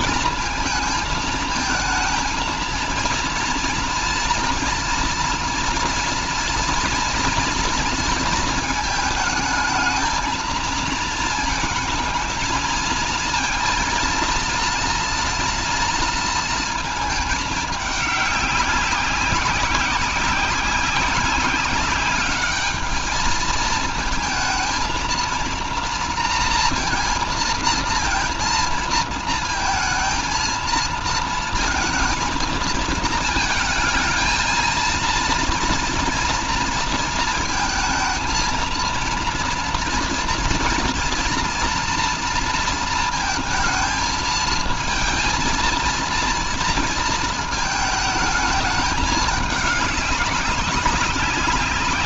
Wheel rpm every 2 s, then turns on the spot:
220, 230, 230, 230, 220, 230, 220, 230, 220, 200, 190, 210, 220, 230, 230, 220, 220, 230, 230, 230, 230, 230, 220, 230, 220, 200.
none